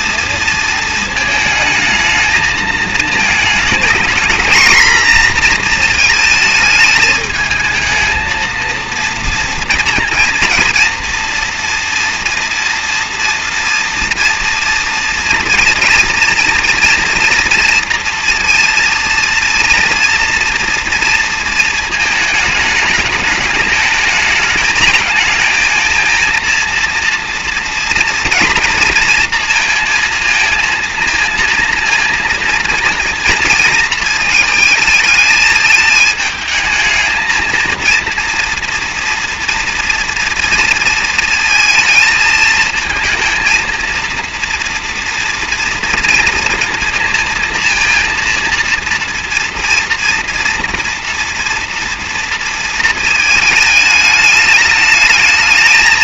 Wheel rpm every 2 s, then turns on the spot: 230, 220, 230, 220, 230, 230, 230, 230, 230, 230, 240, 220, 220, 230, 230, 230, 230, 220, 220, 230, 230, 220, 230, 230, 230, 230, 230, 210.
none